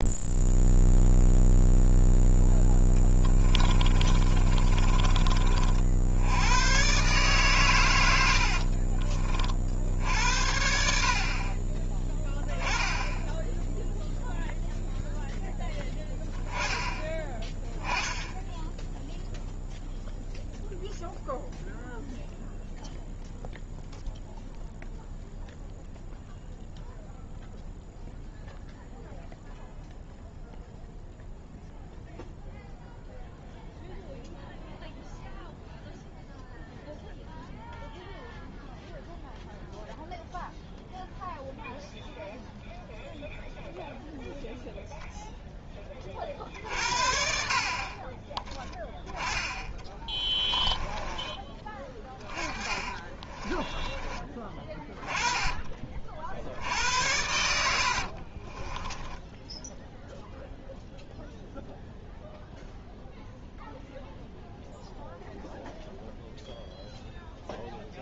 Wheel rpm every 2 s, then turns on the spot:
0, 10, 30, 120, 50, 70, 10, 0, 10, 0, 0, 0, 0, 0, 0, 0, 0, 0, 0, 0, 0, 0, 0, 50, 10, 20, 30, 20, 70, 20, 0, 0, 0, 0.
2-6 8-10 50-56 58-60